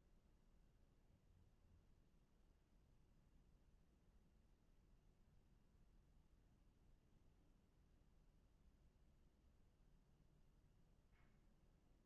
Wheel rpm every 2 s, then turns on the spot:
0, 0, 0, 0, 0, 0.
none